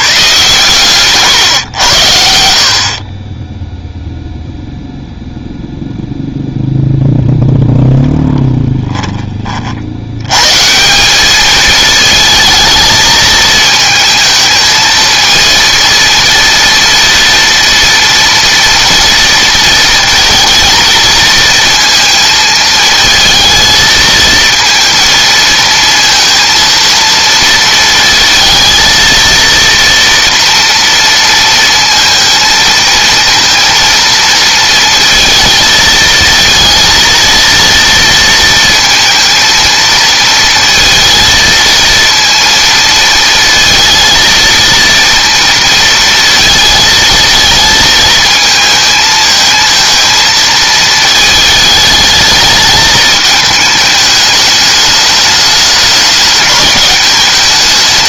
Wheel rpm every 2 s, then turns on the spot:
130, 50, 0, 0, 10, 170, 220, 220, 230, 230, 230, 220, 220, 230, 230, 230, 230, 230, 230, 230, 230, 230, 230, 230, 220, 220, 220, 210, 210.
none